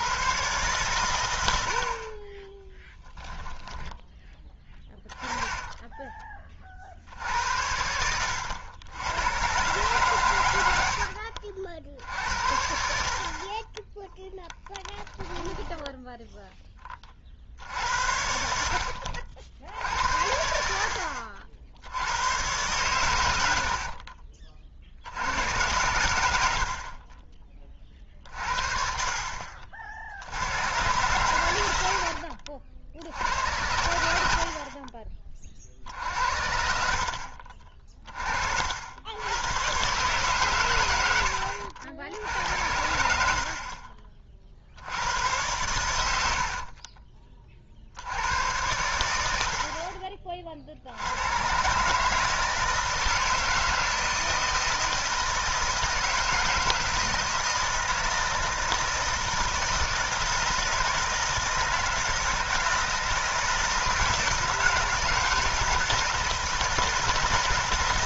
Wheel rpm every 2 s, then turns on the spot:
120, 20, 10, 40, 90, 90, 60, 10, 10, 70, 70, 110, 40, 60, 60, 90, 60, 50, 60, 70, 120, 70, 60, 50, 100, 50, 160, 160, 160, 160, 160, 170, 160, 160.
2-6 14-16 46-48